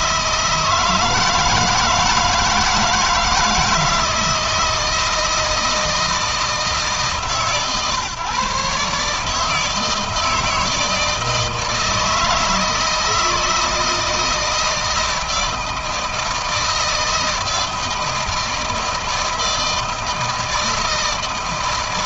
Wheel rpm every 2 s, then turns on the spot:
160, 160, 160, 150, 140, 160, 160, 160, 160, 160, 160.
none